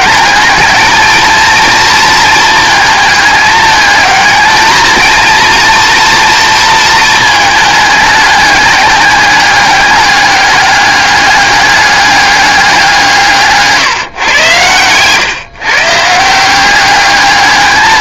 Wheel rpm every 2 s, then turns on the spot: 220, 220, 220, 230, 200, 200, 180, 110, 190.
none